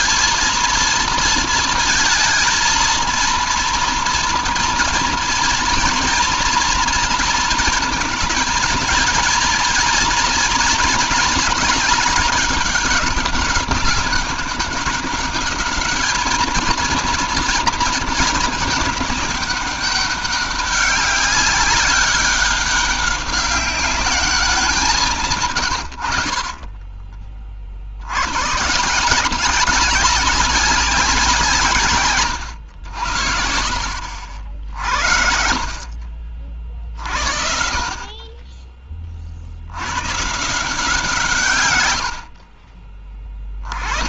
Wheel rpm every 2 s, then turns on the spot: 220, 220, 230, 230, 220, 220, 200, 200, 220, 210, 200, 200, 190, 30, 150, 190, 90, 60, 50, 30, 170, 40.
26-28